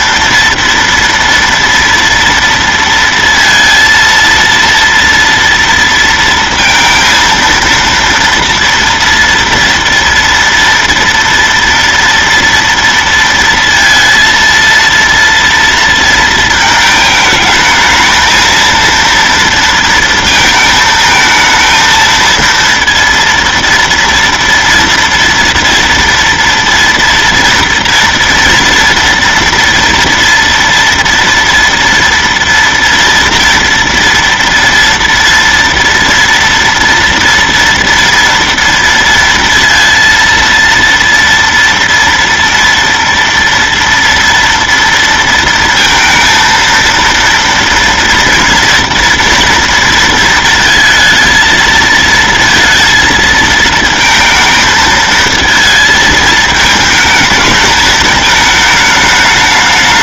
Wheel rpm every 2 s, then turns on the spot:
230, 230, 230, 230, 230, 230, 230, 230, 220, 230, 220, 230, 230, 230, 230, 230, 230, 230, 230, 230, 230, 230, 230, 230, 230, 220, 230, 220, 220, 210.
none